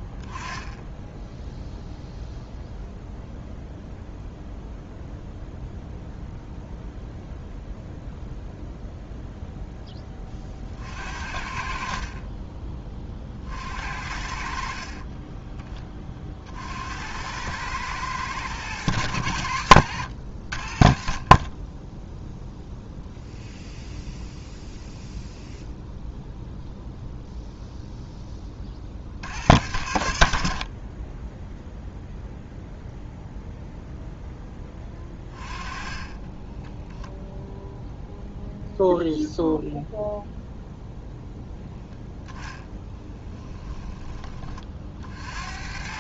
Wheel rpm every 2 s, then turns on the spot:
10, 0, 0, 0, 0, 50, 30, 40, 70, 90, 40, 0, 0, 0, 40, 30, 0, 20, 10, 0, 0, 10, 50.
14-16 42-44